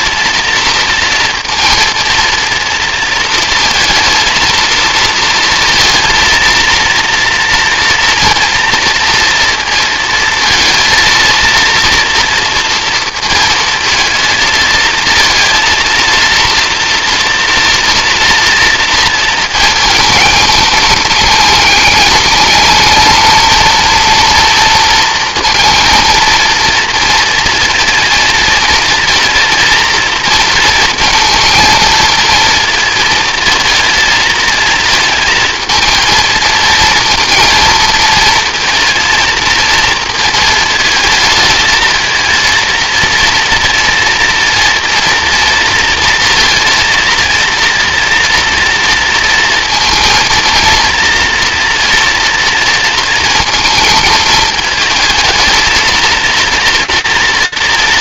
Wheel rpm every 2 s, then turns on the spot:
230, 230, 230, 230, 230, 230, 230, 230, 230, 230, 220, 210, 230, 230, 230, 230, 230, 220, 230, 230, 230, 230, 230, 230, 230, 230, 230, 220, 230.
none